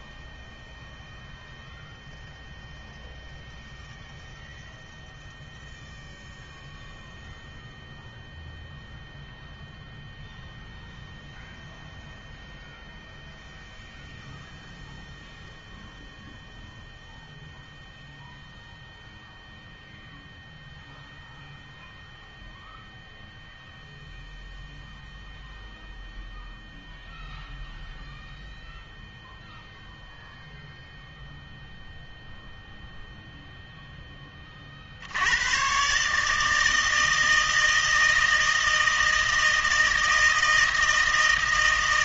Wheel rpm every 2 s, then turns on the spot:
0, 0, 0, 0, 0, 0, 0, 0, 0, 0, 0, 0, 0, 0, 0, 0, 0, 40, 160, 160, 160.
none